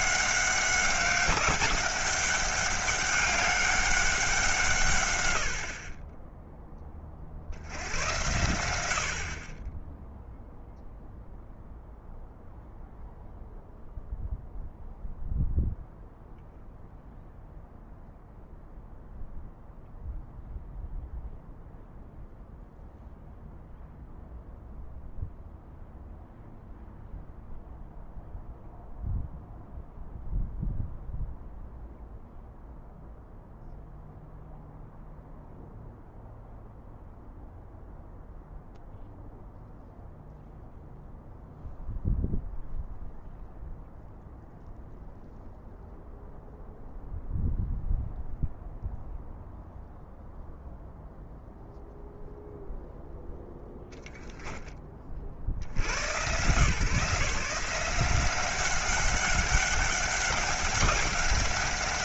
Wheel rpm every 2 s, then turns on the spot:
190, 200, 160, 10, 80, 0, 0, 0, 0, 0, 0, 0, 0, 0, 0, 0, 0, 0, 0, 0, 0, 0, 0, 0, 0, 0, 0, 20, 130, 190, 200.
none